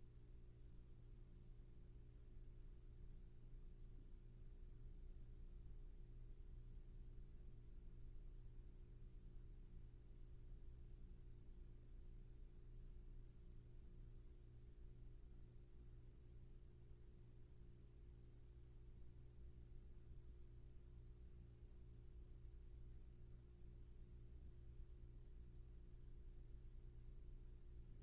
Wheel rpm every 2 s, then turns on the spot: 0, 0, 0, 0, 0, 0, 0, 0, 0, 0, 0, 0, 0, 0.
none